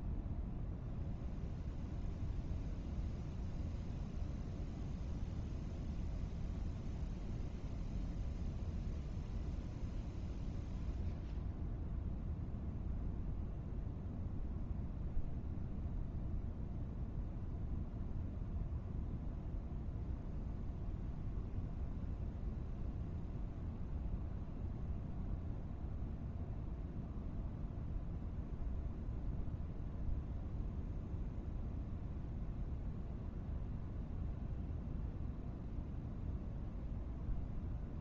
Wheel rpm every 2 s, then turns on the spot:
0, 0, 0, 0, 0, 0, 0, 0, 0, 0, 0, 0, 0, 0, 0, 0, 0, 0, 0.
none